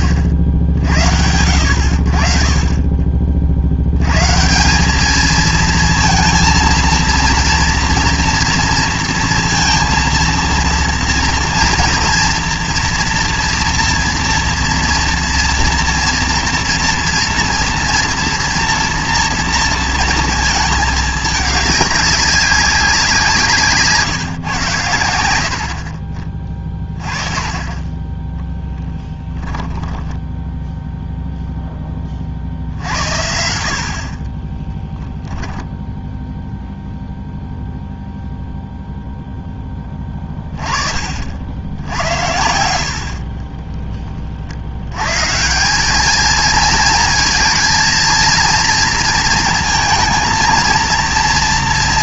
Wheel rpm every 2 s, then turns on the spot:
60, 30, 170, 220, 230, 230, 230, 230, 230, 230, 220, 190, 110, 20, 10, 0, 60, 20, 0, 0, 20, 80, 70, 220, 230, 230.
34-36